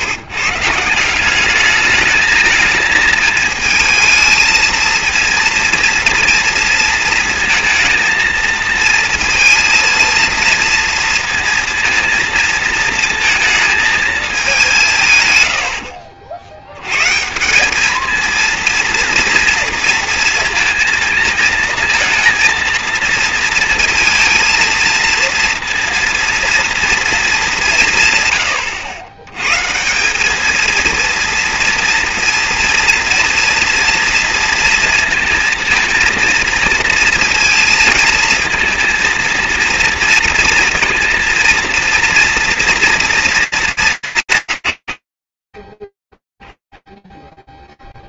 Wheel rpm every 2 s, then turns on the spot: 180, 220, 230, 230, 230, 230, 230, 140, 160, 230, 230, 220, 230, 210, 100, 230, 230, 230, 230, 230, 230, 230, 70, 0.
none